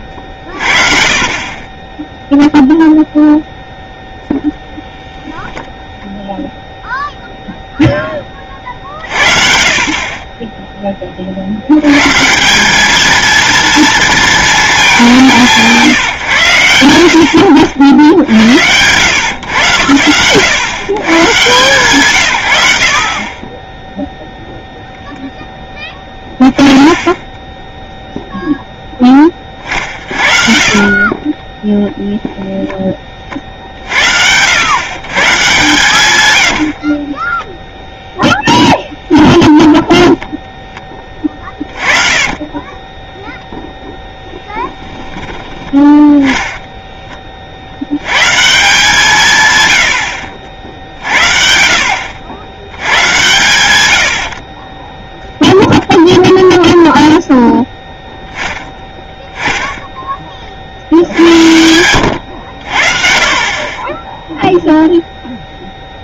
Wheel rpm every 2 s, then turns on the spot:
50, 0, 0, 0, 50, 20, 210, 210, 90, 100, 120, 70, 0, 10, 10, 40, 10, 130, 60, 10, 20, 10, 10, 10, 170, 60, 100, 20, 0, 0, 60, 60, 0.
30-32 36-38 40-48 54-56